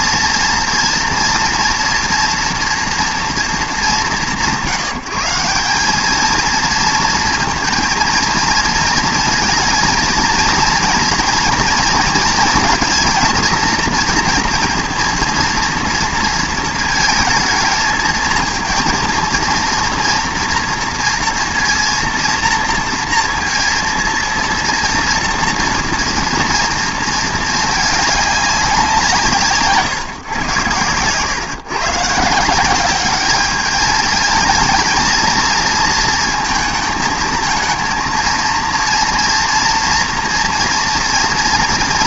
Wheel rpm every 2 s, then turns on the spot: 230, 230, 150, 220, 230, 230, 230, 230, 230, 230, 230, 230, 240, 230, 180, 120, 190, 230, 220, 230, 240.
none